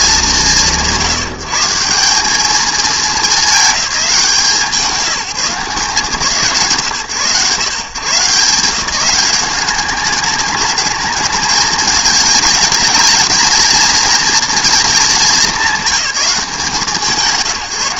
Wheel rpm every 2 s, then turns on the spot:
170, 200, 160, 120, 180, 210, 220, 220, 170.
none